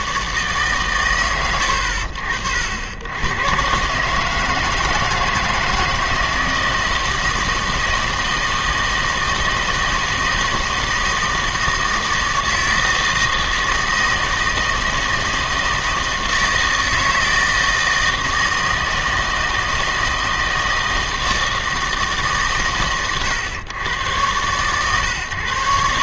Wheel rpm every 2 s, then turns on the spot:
140, 70, 160, 160, 160, 160, 160, 160, 160, 160, 160, 130, 130.
none